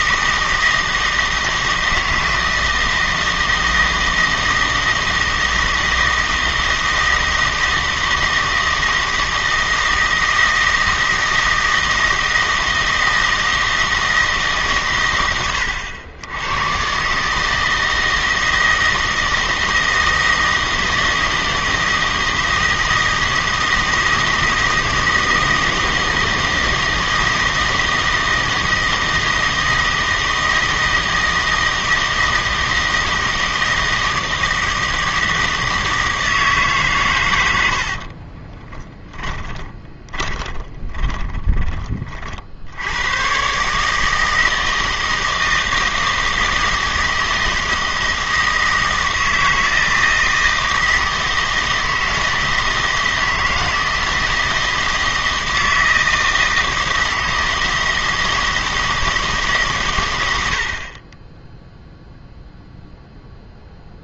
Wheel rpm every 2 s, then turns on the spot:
160, 160, 160, 160, 160, 160, 160, 140, 120, 160, 160, 160, 160, 160, 160, 160, 160, 160, 150, 20, 20, 70, 160, 160, 160, 160, 160, 160, 160, 170, 110, 0.
38-42